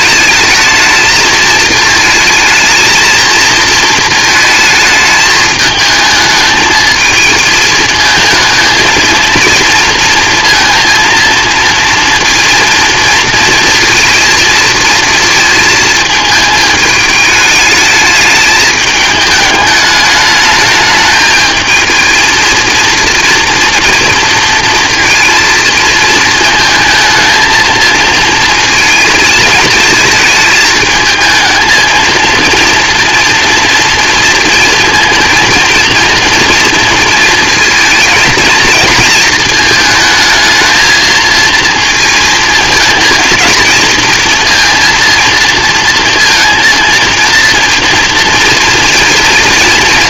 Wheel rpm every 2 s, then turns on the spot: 220, 220, 220, 220, 230, 230, 230, 230, 220, 210, 210, 230, 230, 220, 230, 220, 230, 230, 230, 220, 220, 230, 230, 230, 240.
none